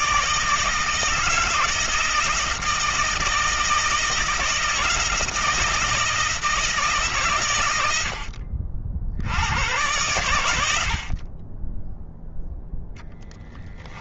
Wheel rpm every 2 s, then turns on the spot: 160, 160, 170, 150, 60, 60, 0.
none